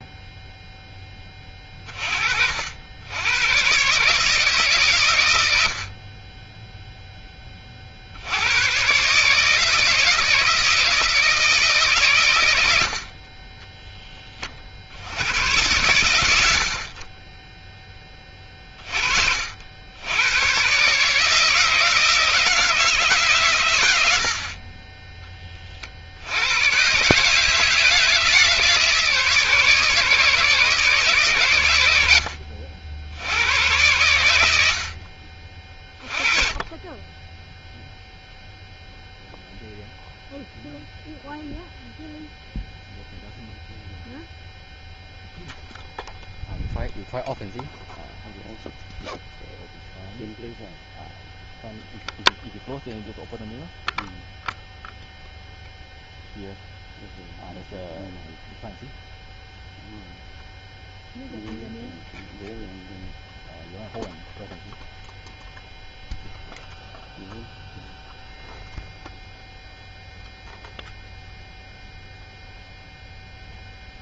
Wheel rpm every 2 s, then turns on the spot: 10, 80, 130, 0, 130, 160, 60, 40, 40, 40, 140, 150, 20, 130, 160, 140, 80, 50, 20, 0, 0, 0, 0, 0, 0, 0, 0, 0, 0, 0, 0, 0, 0, 0, 0, 0, 0.
none